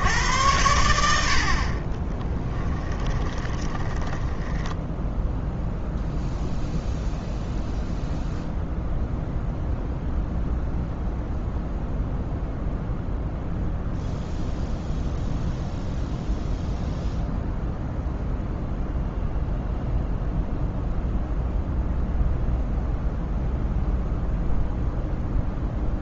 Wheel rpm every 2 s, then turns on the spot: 90, 10, 10, 0, 0, 0, 0, 0, 0, 0, 0, 0, 0.
2-6